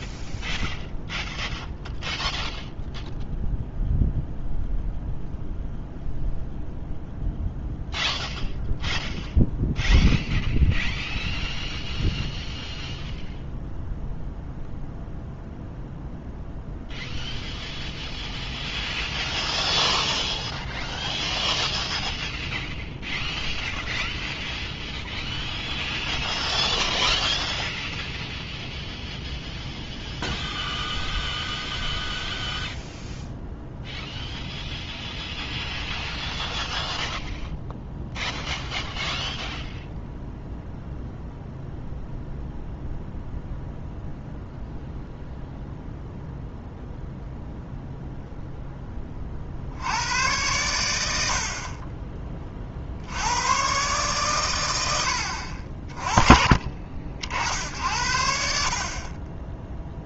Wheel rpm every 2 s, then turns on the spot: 0, 0, 0, 0, 0, 0, 0, 0, 0, 0, 0, 0, 0, 0, 0, 0, 0, 0, 0, 0, 0, 0, 0, 0, 0, 100, 50, 100, 30, 60.
none